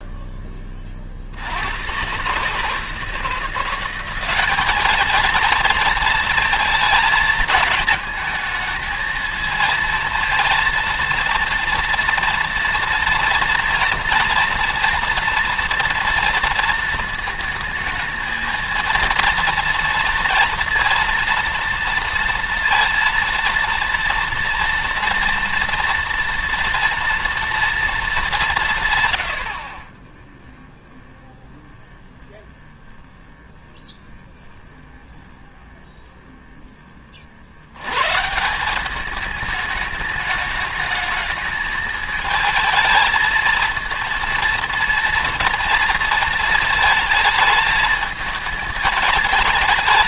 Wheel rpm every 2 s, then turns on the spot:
30, 150, 210, 230, 220, 230, 230, 230, 230, 220, 230, 230, 230, 240, 160, 0, 0, 0, 10, 180, 220, 220, 230, 220, 210.
none